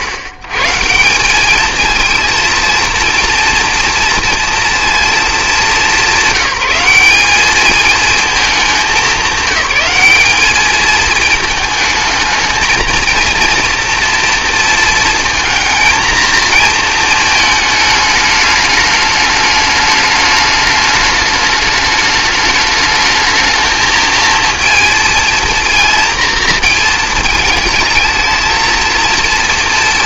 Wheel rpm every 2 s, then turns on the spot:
100, 230, 230, 180, 210, 210, 220, 230, 230, 210, 210, 210, 230, 230, 230.
none